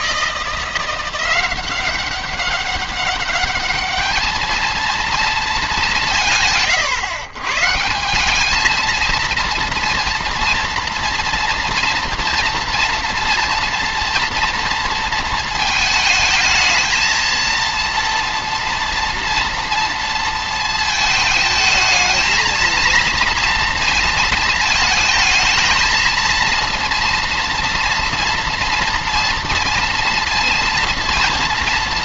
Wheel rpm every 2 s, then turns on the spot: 170, 200, 220, 140, 210, 230, 230, 230, 220, 230, 220, 220, 220, 230, 230, 230.
none